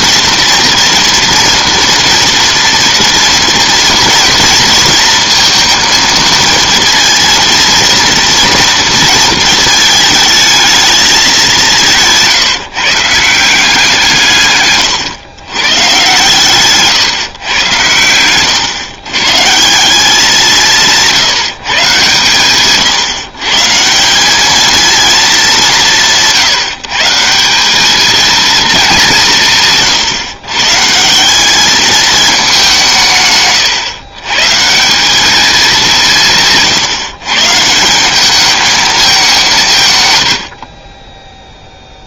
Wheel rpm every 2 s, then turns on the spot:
230, 230, 230, 230, 230, 220, 150, 140, 130, 120, 180, 130, 220, 160, 210, 140, 180, 170, 140, 210, 50.
16-18